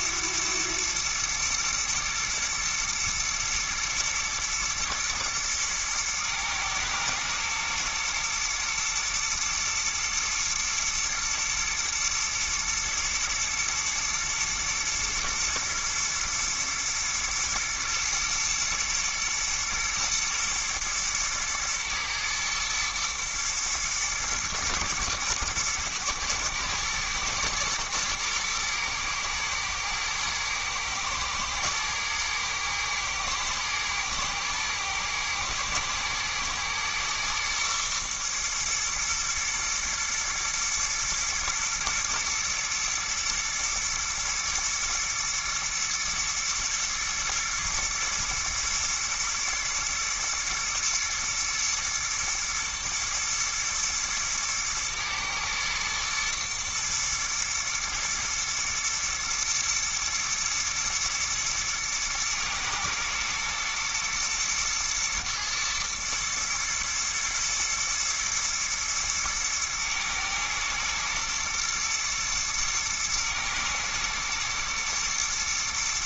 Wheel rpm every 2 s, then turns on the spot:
110, 110, 120, 110, 120, 120, 120, 110, 110, 120, 120, 110, 110, 110, 120, 110, 120, 110, 120, 110, 110, 110, 120, 120, 110, 120, 120, 110, 120, 120, 110, 110, 120, 110, 110, 110, 110, 120.
none